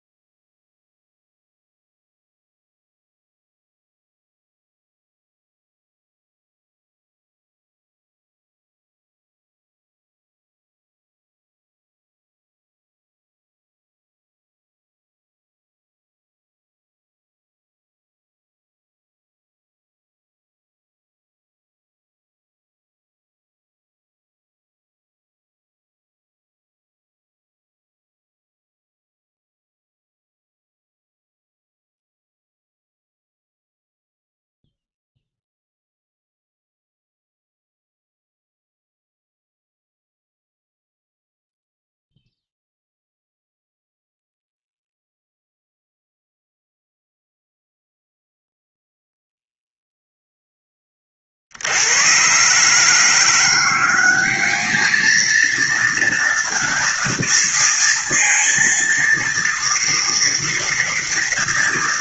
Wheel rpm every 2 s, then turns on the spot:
0, 0, 0, 0, 0, 0, 0, 0, 0, 0, 0, 0, 0, 0, 0, 0, 0, 0, 0, 0, 0, 0, 0, 0, 0, 10, 140, 210, 230, 230, 230.
none